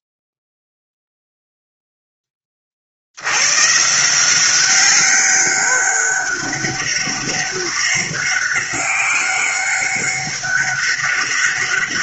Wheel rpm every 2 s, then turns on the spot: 0, 20, 180, 200, 190, 200.
none